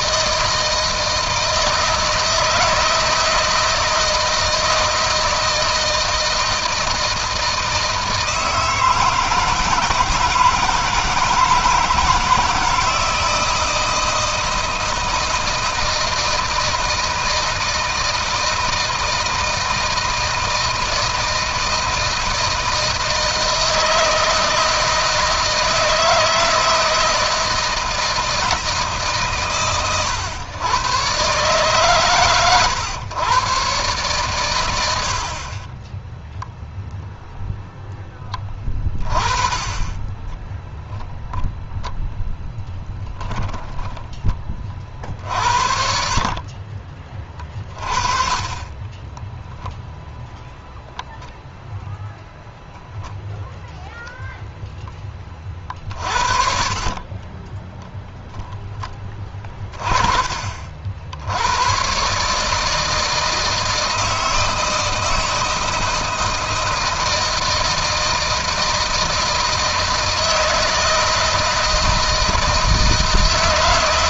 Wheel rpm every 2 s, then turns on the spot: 160, 160, 160, 160, 160, 160, 160, 160, 160, 160, 160, 160, 160, 170, 150, 110, 120, 80, 0, 30, 0, 10, 40, 30, 20, 0, 0, 10, 40, 20, 60, 160, 160, 160, 160, 160, 160.
42-44 48-50 56-58